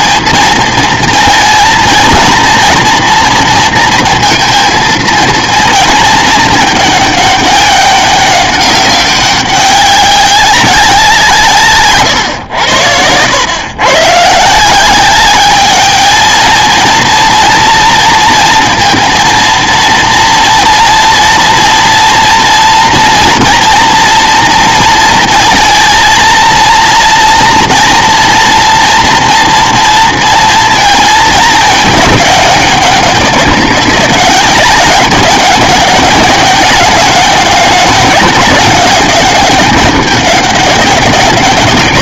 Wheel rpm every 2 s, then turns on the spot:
220, 230, 230, 210, 190, 180, 100, 180, 230, 230, 230, 230, 230, 230, 230, 230, 200, 200, 200, 200, 200.
none